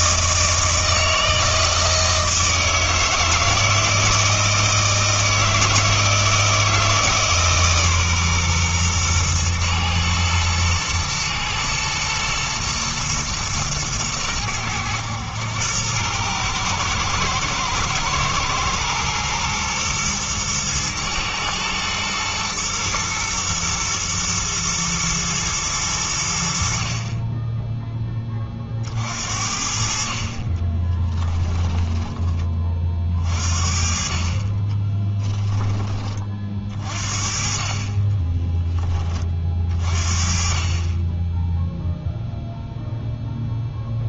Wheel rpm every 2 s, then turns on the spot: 160, 160, 160, 160, 120, 120, 120, 100, 110, 120, 110, 110, 110, 50, 50, 10, 40, 20, 40, 20, 30, 0.
30-32 34-36